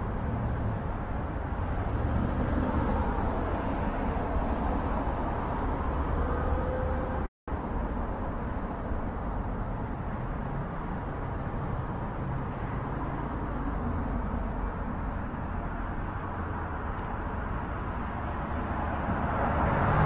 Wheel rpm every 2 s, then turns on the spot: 0, 0, 0, 0, 0, 0, 0, 0, 0, 0.
none